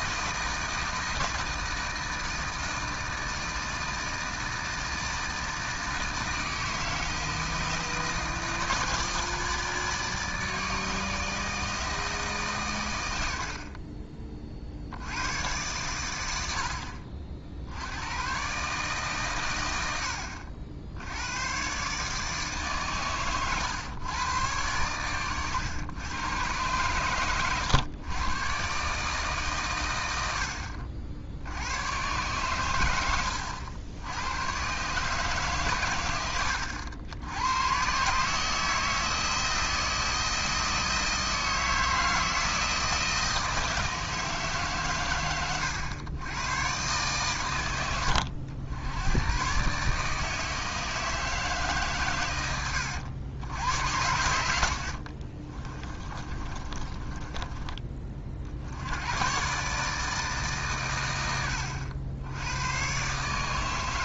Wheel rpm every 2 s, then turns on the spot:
160, 160, 160, 160, 160, 160, 110, 80, 60, 140, 90, 120, 110, 120, 140, 60, 100, 140, 80, 160, 160, 160, 120, 120, 100, 160, 90, 60, 30, 90, 120, 130.
54-58